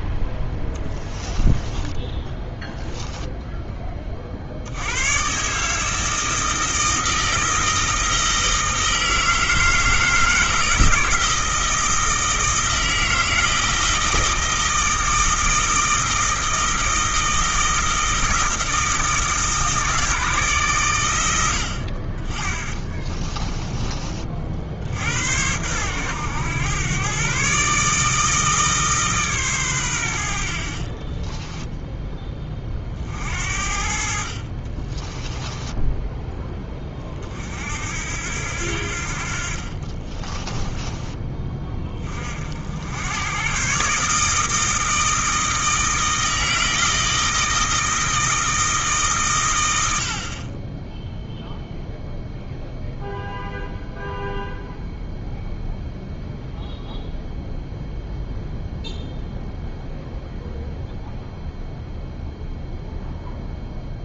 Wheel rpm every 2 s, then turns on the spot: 10, 10, 90, 160, 160, 160, 160, 160, 160, 160, 120, 20, 60, 120, 150, 50, 40, 30, 20, 70, 20, 80, 160, 160, 150, 10, 0, 0, 0, 0, 0, 0.
0-4 22-24 30-32 34-36 40-42